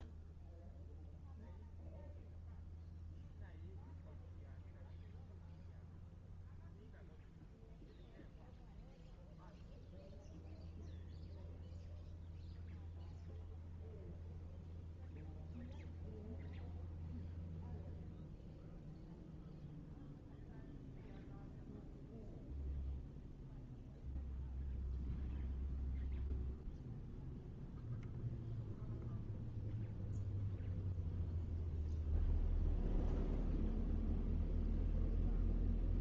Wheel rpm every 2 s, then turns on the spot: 0, 0, 0, 0, 0, 0, 0, 0, 0, 0, 0, 0, 0, 0, 0, 0, 0, 0.
none